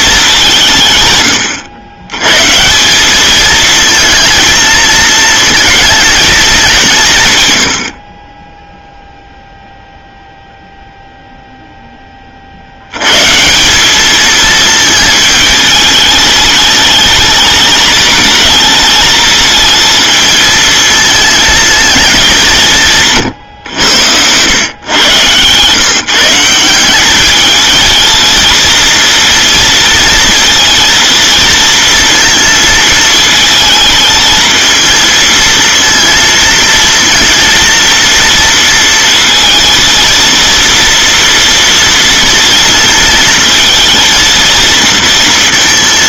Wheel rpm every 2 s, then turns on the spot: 170, 160, 230, 190, 10, 0, 80, 220, 210, 220, 220, 170, 120, 180, 230, 230, 220, 220, 230, 230, 230, 230, 230.
none